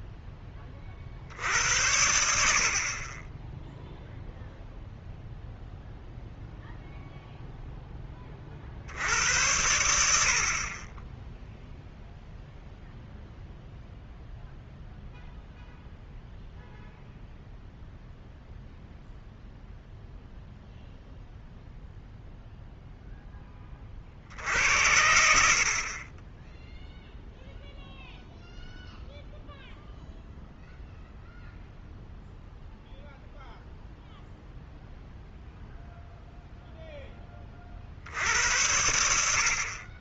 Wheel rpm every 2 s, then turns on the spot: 20, 50, 0, 0, 50, 40, 0, 0, 0, 0, 0, 0, 70, 10, 0, 0, 0, 0, 0, 80.
none